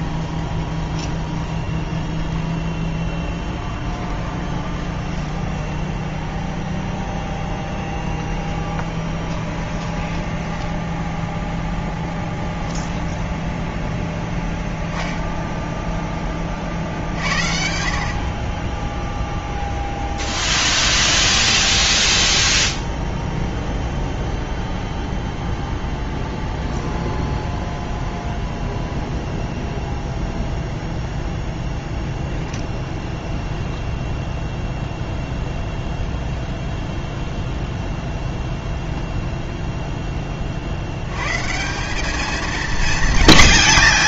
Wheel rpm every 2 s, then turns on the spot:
20, 10, 20, 0, 20, 10, 10, 0, 50, 20, 20, 10, 10, 0, 0, 0, 0, 0, 0, 0, 70, 220.
0-6 8-14 20-24